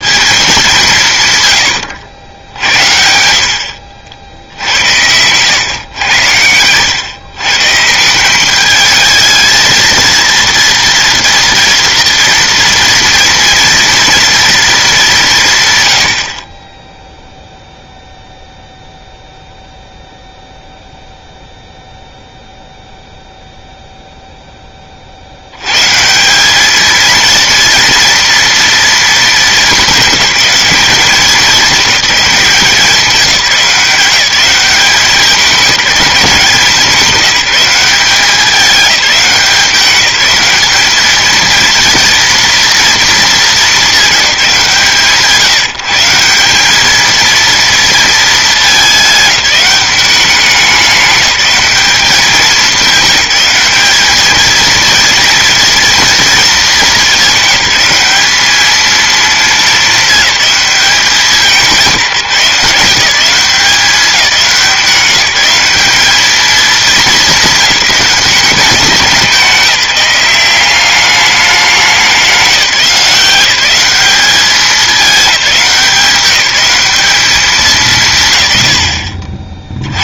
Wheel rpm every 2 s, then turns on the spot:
180, 70, 80, 110, 210, 230, 230, 220, 20, 0, 0, 0, 20, 210, 230, 200, 180, 190, 180, 200, 210, 230, 170, 210, 210, 200, 200, 230, 220, 220, 210, 180, 180, 210, 190, 200, 180, 190, 200, 110.
4-6